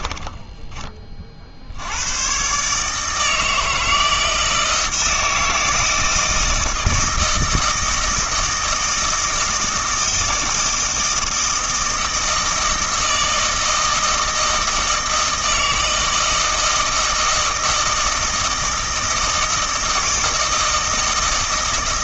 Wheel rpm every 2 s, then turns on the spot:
20, 140, 160, 160, 160, 160, 160, 160, 160, 160, 160.
none